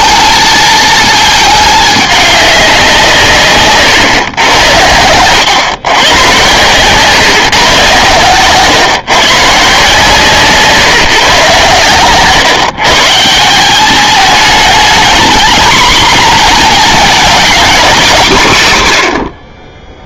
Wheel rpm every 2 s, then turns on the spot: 220, 180, 90, 120, 120, 150, 140, 220, 230, 140.
none